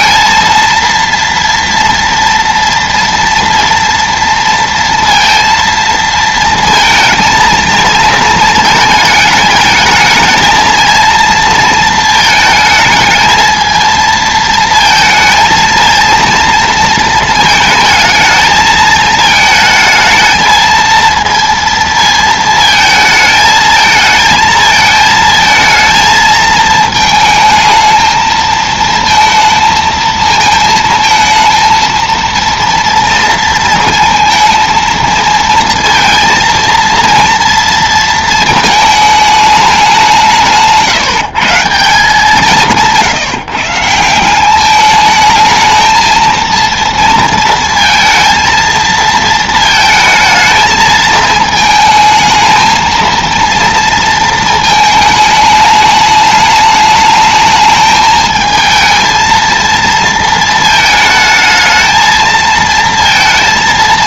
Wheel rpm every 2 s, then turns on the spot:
230, 230, 230, 230, 220, 220, 220, 220, 230, 220, 220, 220, 220, 220, 220, 220, 230, 230, 230, 220, 150, 170, 200, 230, 230, 220, 220, 220, 210, 220, 220, 230.
none